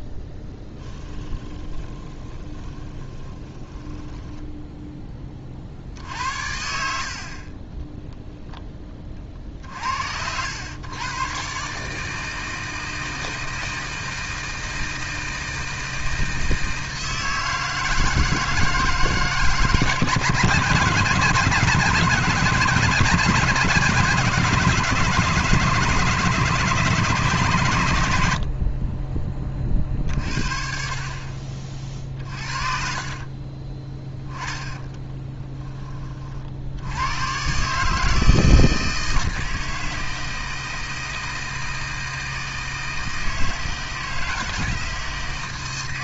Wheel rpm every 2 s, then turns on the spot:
10, 20, 10, 60, 10, 100, 160, 160, 160, 160, 150, 160, 160, 160, 30, 50, 40, 20, 80, 160, 160, 160, 160.
0-4 6-8 28-30 32-36